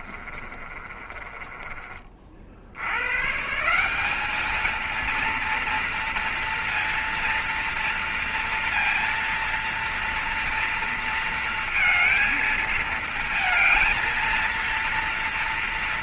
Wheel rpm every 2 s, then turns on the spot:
30, 60, 210, 230, 230, 230, 220, 230.
0-2